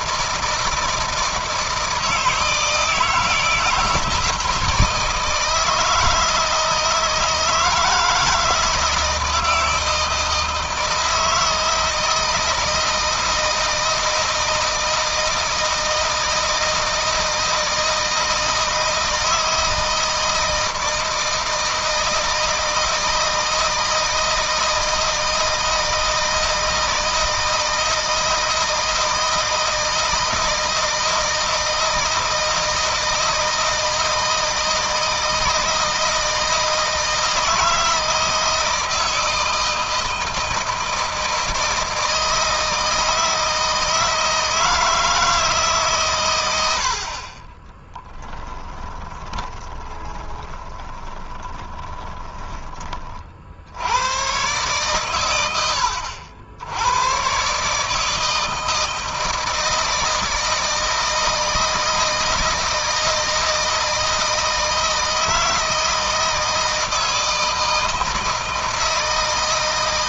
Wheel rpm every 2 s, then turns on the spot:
160, 160, 160, 160, 160, 160, 160, 160, 160, 160, 160, 160, 160, 160, 160, 160, 160, 160, 160, 160, 160, 160, 160, 100, 20, 20, 20, 130, 90, 160, 160, 160, 160, 160, 160.
48-52